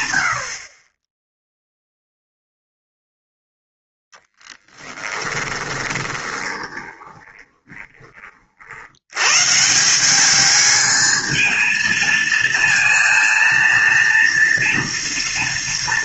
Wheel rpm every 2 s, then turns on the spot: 20, 0, 20, 20, 90, 220, 230, 240.
4-8